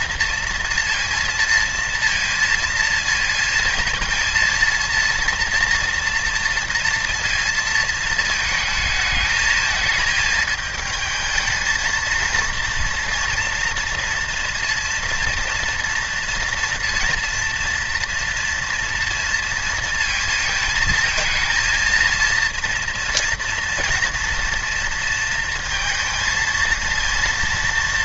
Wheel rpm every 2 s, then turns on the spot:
230, 230, 230, 230, 220, 220, 230, 230, 230, 230, 220, 230, 230, 230.
none